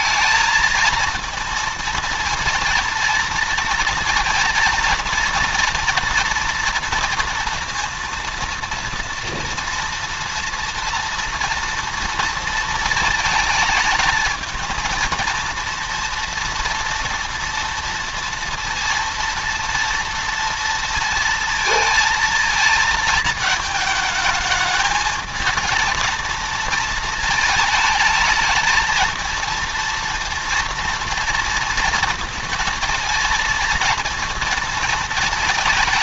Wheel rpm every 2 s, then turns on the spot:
230, 230, 230, 230, 230, 230, 230, 230, 230, 230, 230, 220, 220, 230, 220, 230, 230, 230.
none